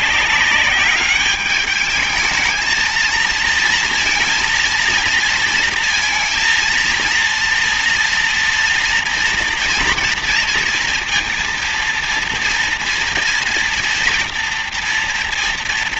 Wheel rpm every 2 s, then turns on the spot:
200, 220, 230, 230, 230, 230, 230, 230.
none